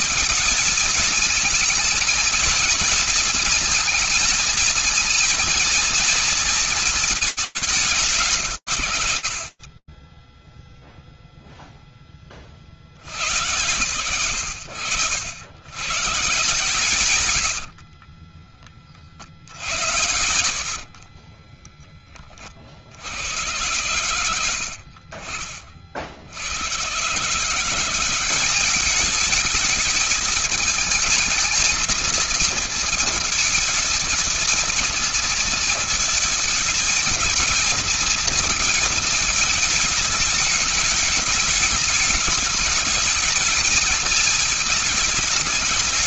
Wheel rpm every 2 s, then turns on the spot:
220, 230, 230, 230, 130, 20, 10, 80, 150, 50, 50, 90, 50, 140, 210, 230, 220, 230, 220, 220, 210, 220, 210.
16-18 20-22